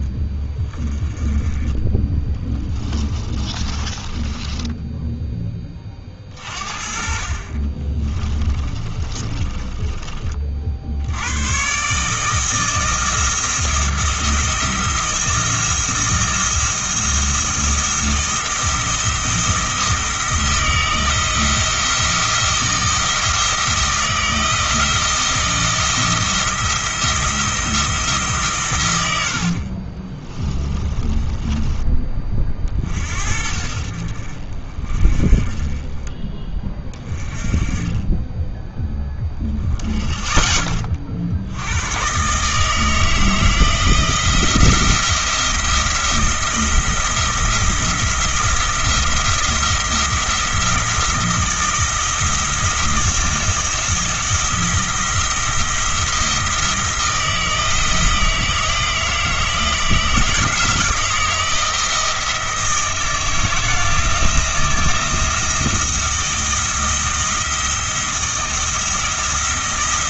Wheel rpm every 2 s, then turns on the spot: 20, 10, 10, 50, 30, 60, 160, 170, 160, 170, 170, 170, 170, 170, 130, 20, 40, 40, 20, 10, 20, 160, 170, 170, 170, 170, 170, 170, 160, 160, 160, 160, 170, 170, 170.
2-6 8-10 30-32